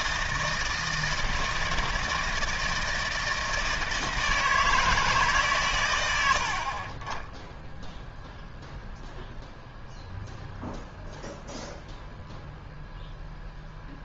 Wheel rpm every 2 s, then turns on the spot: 160, 160, 160, 40, 0, 0, 0.
none